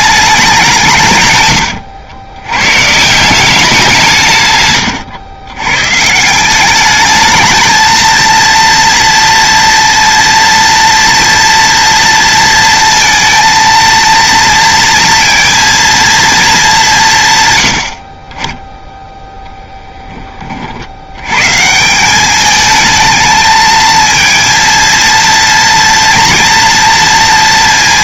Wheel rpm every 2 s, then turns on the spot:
180, 120, 120, 200, 230, 230, 230, 230, 200, 10, 80, 220, 230, 240.
none